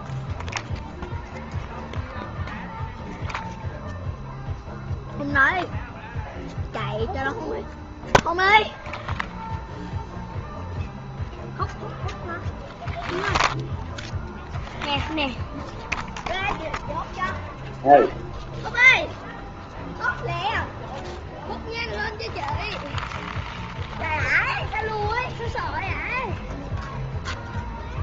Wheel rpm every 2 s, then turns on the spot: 0, 0, 0, 0, 0, 0, 0, 0, 0, 0, 0, 0, 0, 0.
none